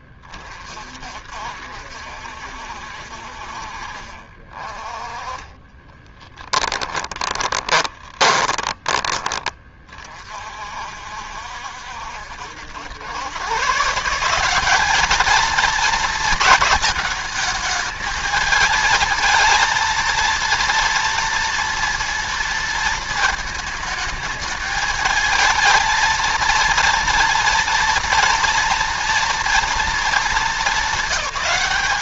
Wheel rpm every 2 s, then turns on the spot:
50, 60, 40, 10, 20, 50, 80, 190, 220, 220, 230, 230, 220, 230, 230, 220.
6-8